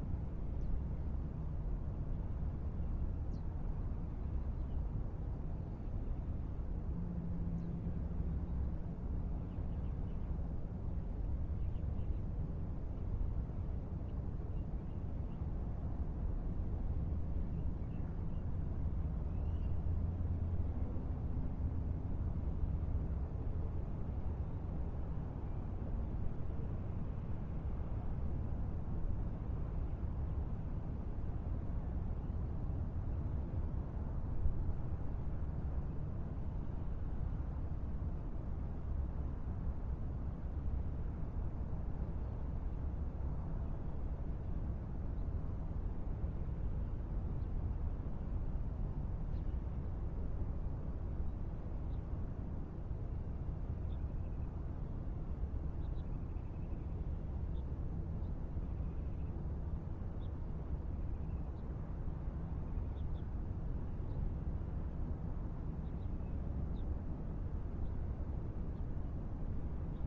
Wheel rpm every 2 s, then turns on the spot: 0, 0, 0, 0, 0, 0, 0, 0, 0, 0, 0, 0, 0, 0, 0, 0, 0, 0, 0, 0, 0, 0, 0, 0, 0, 0, 0, 0, 0, 0, 0, 0, 0, 0, 0.
none